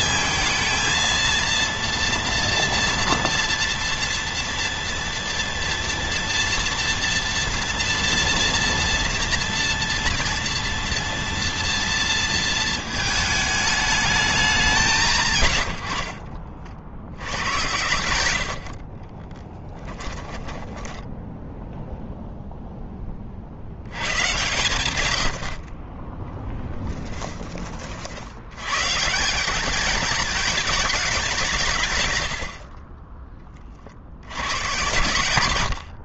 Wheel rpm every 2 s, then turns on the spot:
230, 230, 230, 230, 230, 230, 230, 190, 70, 60, 20, 0, 120, 10, 110, 220, 70, 100.
20-22 26-28 32-34